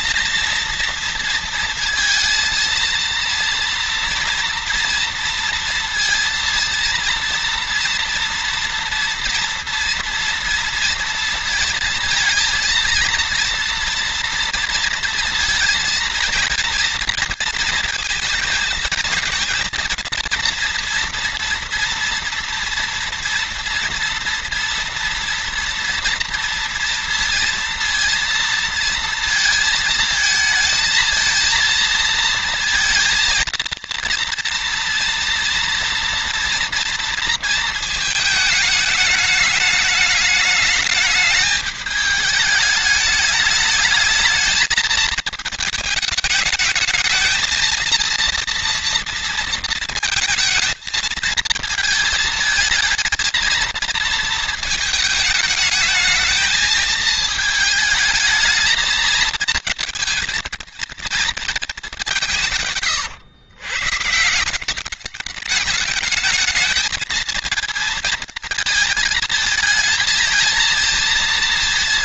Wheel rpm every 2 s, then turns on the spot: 230, 230, 230, 230, 230, 230, 230, 230, 230, 230, 230, 230, 230, 230, 230, 220, 230, 230, 230, 210, 210, 210, 220, 220, 230, 230, 220, 220, 220, 220, 230, 120, 200, 220, 220, 230.
none